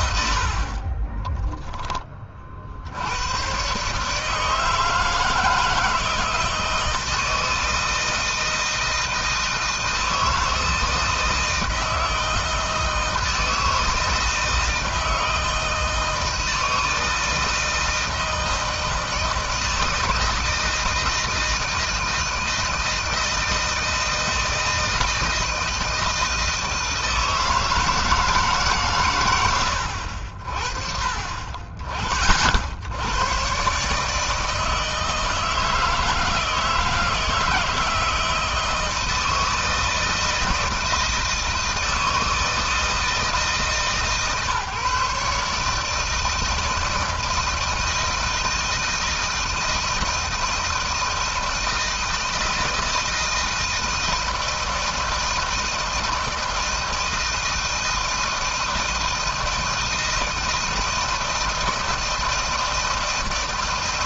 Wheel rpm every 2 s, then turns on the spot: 30, 60, 160, 160, 160, 160, 160, 160, 160, 160, 160, 160, 160, 160, 140, 50, 70, 160, 160, 160, 160, 160, 150, 160, 160, 160, 160, 160, 160, 160, 160, 160.
none